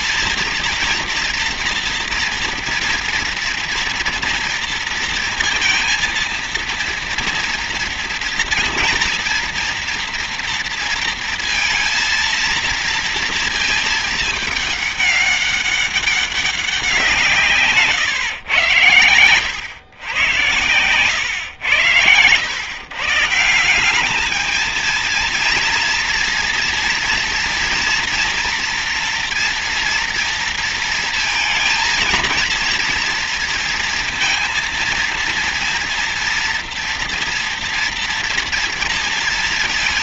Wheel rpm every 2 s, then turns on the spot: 230, 230, 230, 230, 230, 230, 230, 210, 170, 100, 100, 140, 220, 230, 230, 230, 230, 230, 230, 230.
none